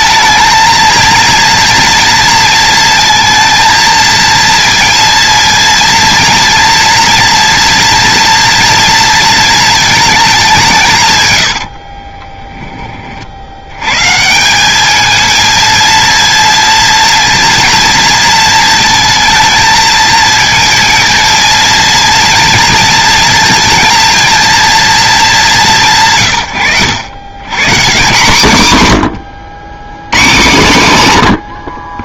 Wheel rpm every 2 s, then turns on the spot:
230, 230, 230, 230, 230, 160, 30, 210, 230, 230, 230, 230, 220, 100, 130, 130.
none